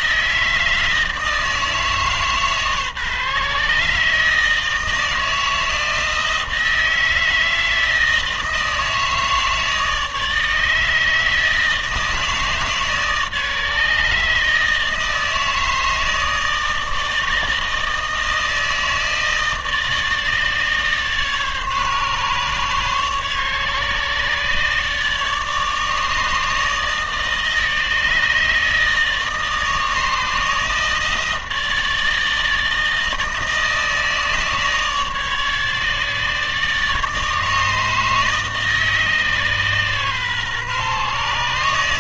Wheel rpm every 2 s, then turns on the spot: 160, 140, 160, 160, 160, 160, 150, 150, 160, 160, 150, 140, 150, 150, 150, 160, 160, 150, 150, 150, 140.
none